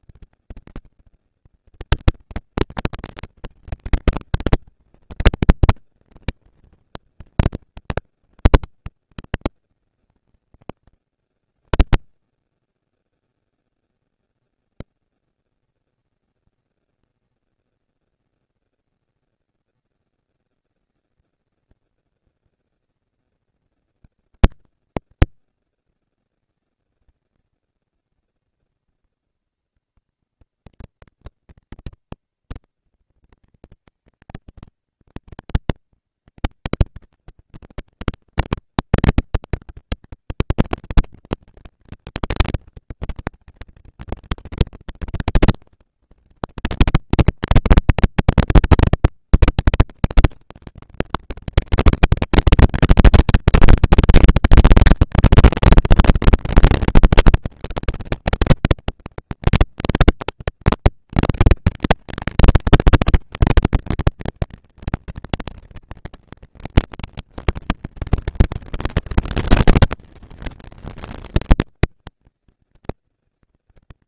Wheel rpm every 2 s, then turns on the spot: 220, 230, 230, 230, 200, 150, 130, 220, 230, 230, 230, 230, 220, 220, 220, 230, 230, 220, 220, 230, 230, 230, 220, 210, 230, 240, 220, 220, 210, 200, 210, 220, 230, 230, 230, 230, 220.
none